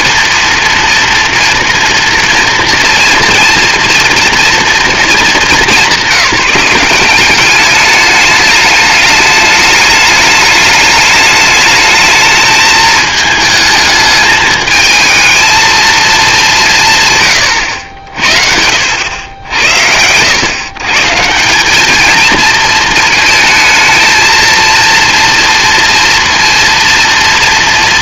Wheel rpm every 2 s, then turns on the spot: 230, 240, 210, 200, 210, 210, 220, 230, 120, 80, 180, 230, 230, 230.
none